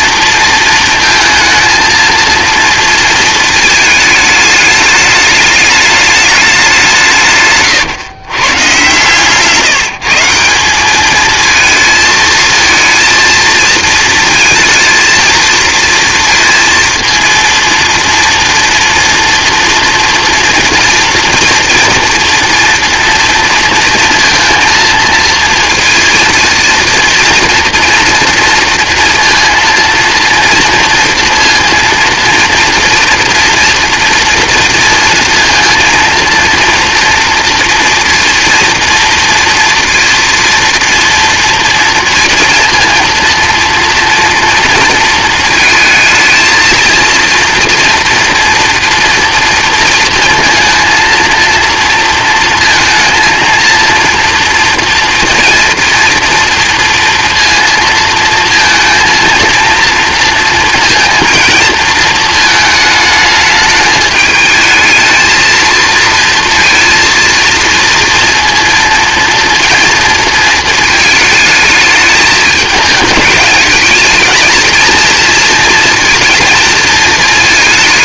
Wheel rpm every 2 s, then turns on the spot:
230, 220, 210, 170, 140, 220, 230, 230, 230, 230, 230, 230, 230, 230, 230, 230, 240, 230, 240, 230, 230, 230, 230, 230, 230, 230, 230, 230, 230, 230, 230, 210, 220, 230, 230, 220, 220, 220, 230.
none